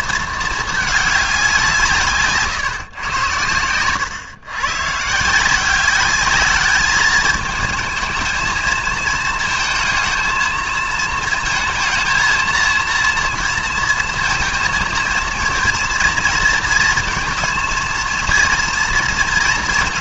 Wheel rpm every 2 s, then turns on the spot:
220, 140, 130, 210, 230, 220, 230, 230, 220, 230.
none